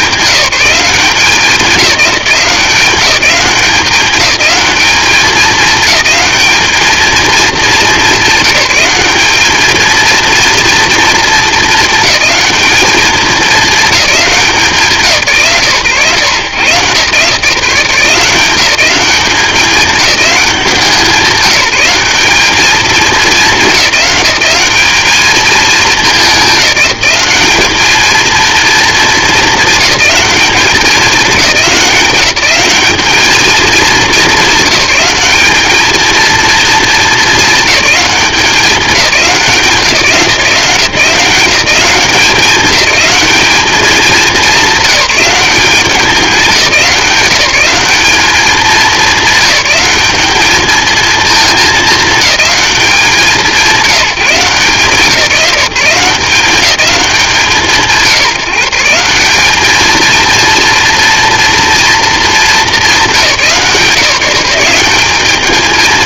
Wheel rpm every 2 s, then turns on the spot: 200, 180, 210, 220, 200, 230, 210, 170, 120, 190, 190, 210, 210, 200, 230, 190, 200, 210, 230, 190, 170, 210, 200, 190, 210, 220, 190, 170, 190, 170, 230, 200, 190.
none